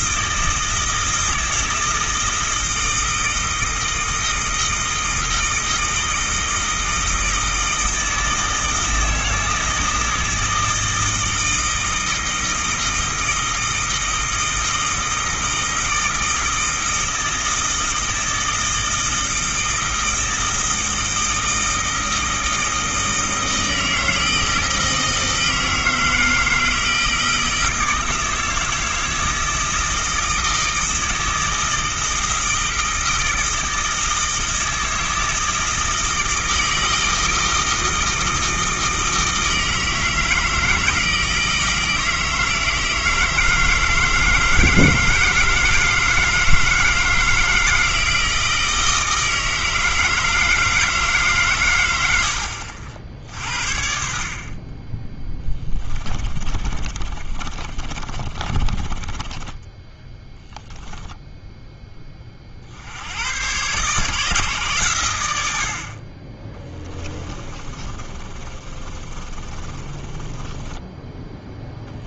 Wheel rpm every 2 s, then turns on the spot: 160, 160, 160, 160, 160, 160, 160, 160, 160, 160, 160, 160, 160, 160, 160, 160, 160, 160, 160, 160, 160, 160, 160, 160, 160, 160, 60, 30, 30, 20, 0, 60, 130, 20, 30, 10.
56-60 66-72